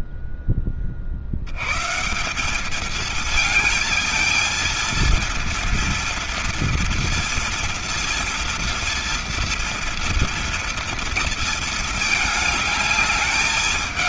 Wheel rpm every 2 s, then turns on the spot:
10, 200, 230, 230, 230, 230, 220.
none